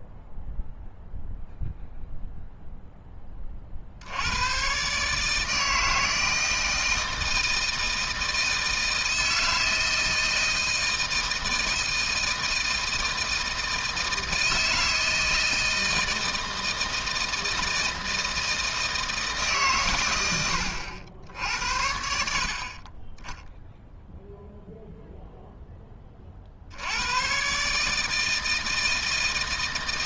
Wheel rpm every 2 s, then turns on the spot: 0, 0, 100, 160, 160, 160, 160, 160, 160, 170, 80, 60, 0, 50, 160.
none